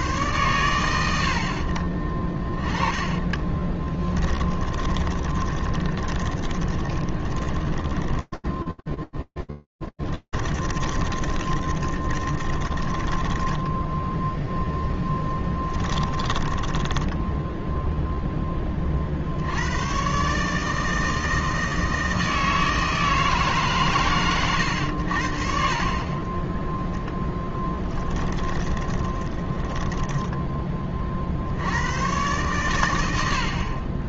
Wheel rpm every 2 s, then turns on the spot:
80, 40, 20, 20, 10, 10, 20, 10, 20, 10, 150, 160, 100, 10, 20, 40, 110.
2-14 16-18 26-30